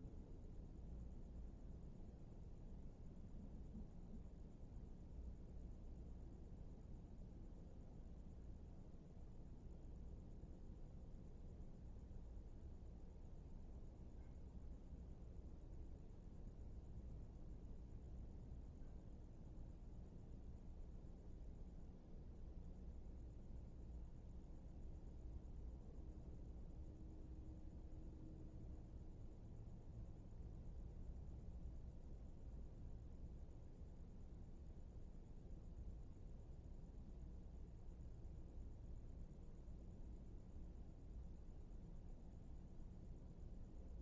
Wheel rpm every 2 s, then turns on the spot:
0, 0, 0, 0, 0, 0, 0, 0, 0, 0, 0, 0, 0, 0, 0, 0, 0, 0, 0, 0, 0, 0.
none